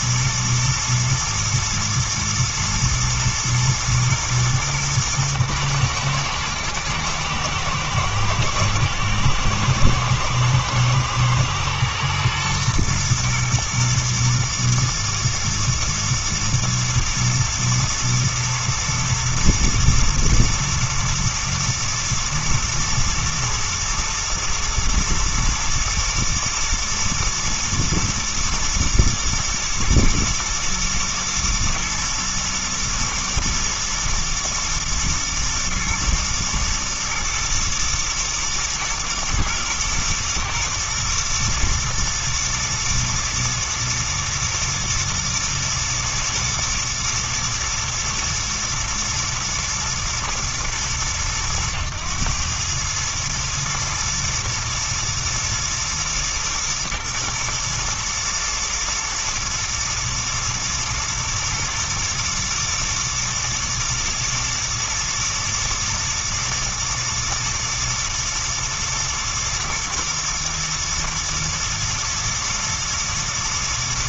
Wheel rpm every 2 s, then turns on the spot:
110, 110, 110, 110, 110, 120, 110, 120, 110, 110, 110, 120, 110, 110, 120, 120, 110, 110, 110, 110, 120, 120, 120, 120, 110, 110, 110, 120, 110, 110, 110, 110, 110, 120, 110, 110, 110.
none